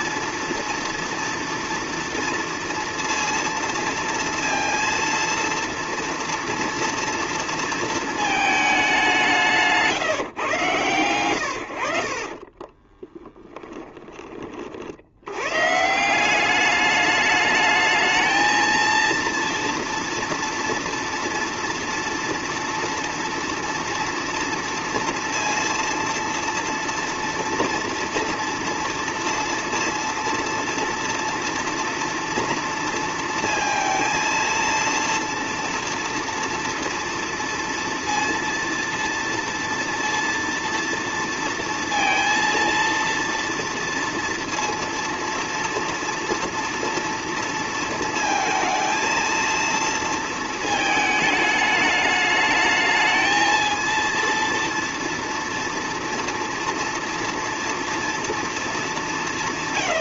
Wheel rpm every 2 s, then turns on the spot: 230, 230, 230, 230, 220, 140, 20, 40, 200, 230, 230, 240, 230, 230, 230, 230, 230, 230, 230, 230, 230, 230, 230, 240, 230, 220, 220, 230, 230, 220.
12-14